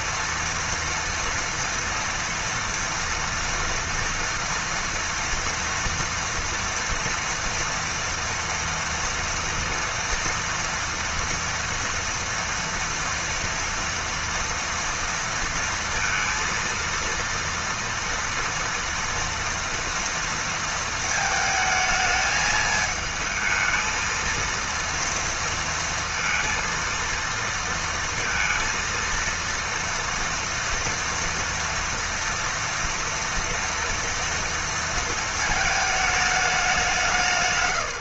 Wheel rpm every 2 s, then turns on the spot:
230, 230, 230, 230, 230, 230, 240, 230, 230, 230, 230, 220, 230, 230, 230, 230, 240, 230, 200.
none